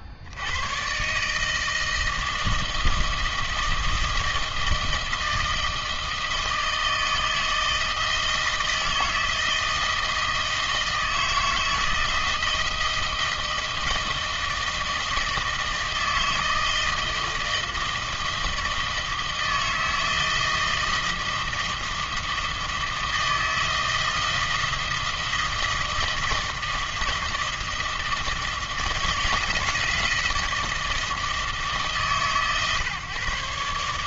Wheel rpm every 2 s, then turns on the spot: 80, 160, 160, 160, 160, 160, 160, 160, 160, 160, 160, 160, 160, 160, 160, 160, 120.
none